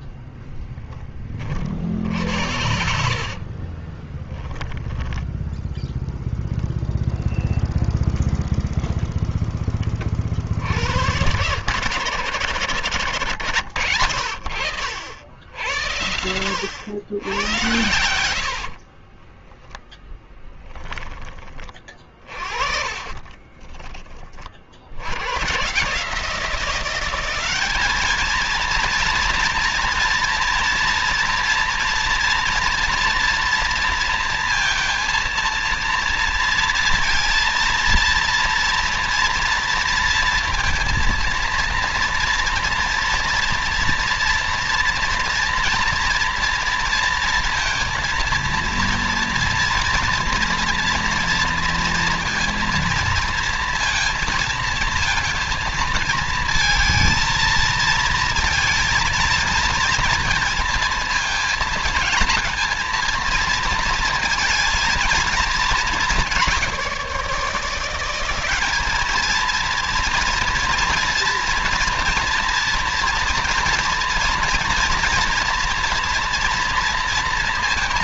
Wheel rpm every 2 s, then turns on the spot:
30, 70, 20, 0, 0, 80, 90, 70, 100, 40, 10, 30, 70, 180, 230, 230, 230, 230, 230, 230, 230, 230, 230, 230, 230, 230, 230, 230, 220, 230, 220, 230, 230, 170, 210, 230, 230, 230, 230.
2-4 18-20 22-24